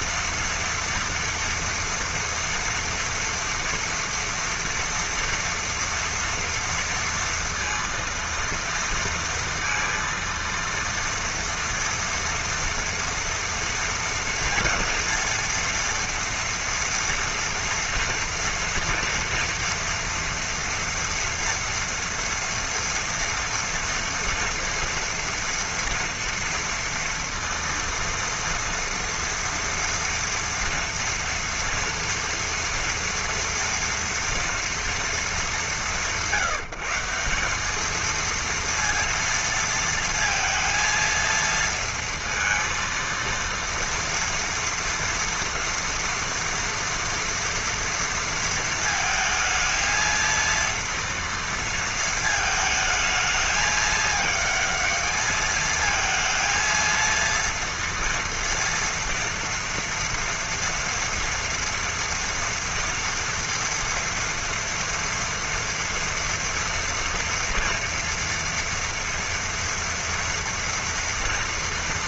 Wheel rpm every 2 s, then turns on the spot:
230, 230, 230, 230, 230, 230, 240, 230, 230, 230, 230, 230, 230, 230, 230, 230, 230, 210, 180, 230, 230, 230, 230, 230, 220, 230, 220, 220, 230, 230, 230, 230, 230, 230, 240, 230.
none